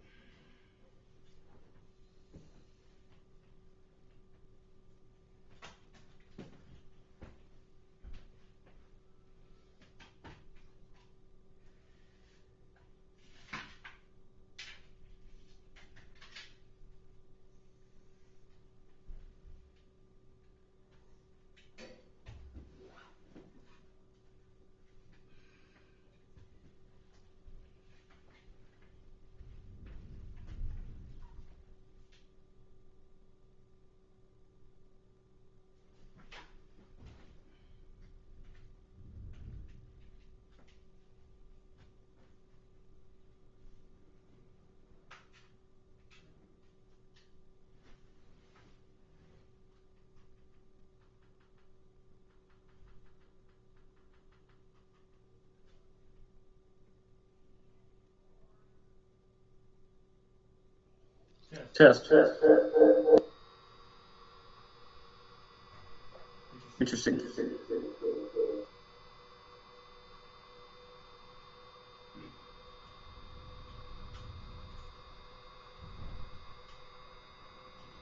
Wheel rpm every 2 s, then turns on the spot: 0, 0, 0, 0, 0, 0, 0, 0, 0, 0, 0, 0, 0, 0, 0, 0, 0, 0, 0, 0, 0, 0, 0, 0, 0, 0, 0, 0, 0, 0, 0, 0, 0, 0, 0, 0, 0, 0, 0.
none